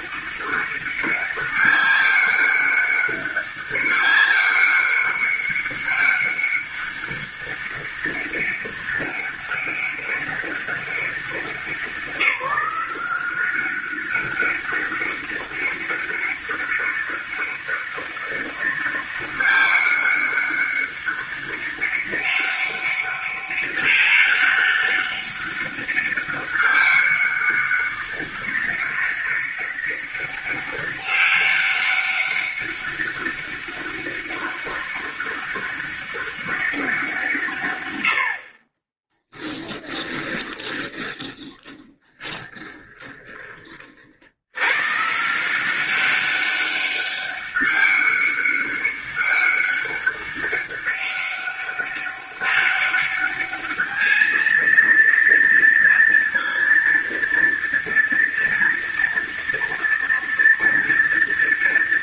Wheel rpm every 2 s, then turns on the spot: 200, 200, 200, 200, 200, 200, 180, 200, 200, 200, 200, 200, 200, 200, 200, 200, 200, 200, 190, 30, 20, 20, 110, 200, 200, 200, 200, 230, 230, 230, 230.
40-44